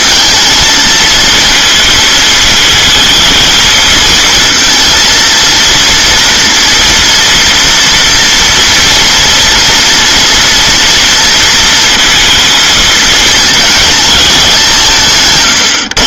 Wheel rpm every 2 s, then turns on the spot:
230, 230, 230, 230, 230, 230, 230, 180.
none